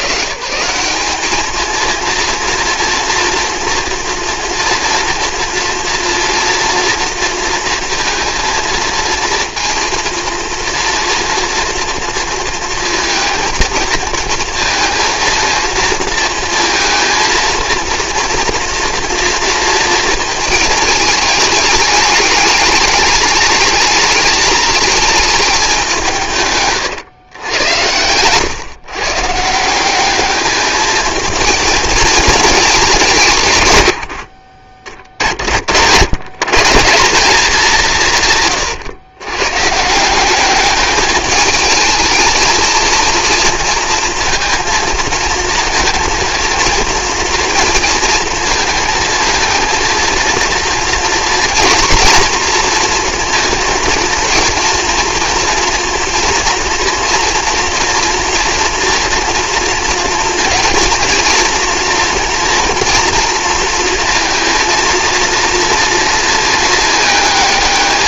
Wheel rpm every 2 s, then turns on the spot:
170, 230, 230, 230, 230, 230, 230, 230, 230, 240, 220, 210, 220, 150, 130, 210, 210, 60, 150, 130, 200, 230, 230, 230, 230, 230, 230, 230, 240, 230, 230, 230, 230, 220.
26-28